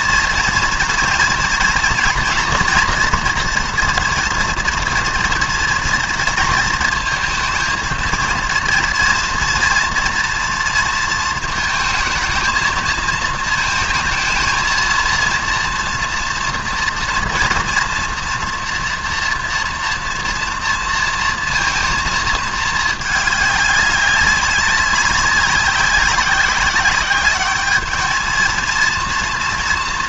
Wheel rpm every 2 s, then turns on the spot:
230, 230, 230, 220, 230, 230, 220, 230, 230, 230, 230, 220, 200, 190, 230.
none